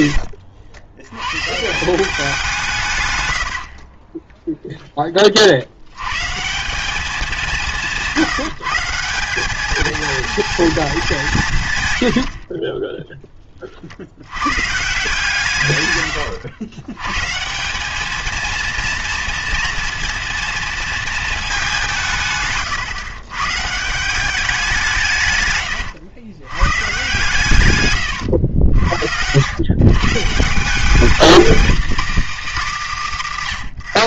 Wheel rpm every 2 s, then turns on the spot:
80, 170, 0, 170, 160, 230, 40, 110, 110, 230, 230, 130, 190, 120, 80, 180, 250.
12-14 22-24 28-30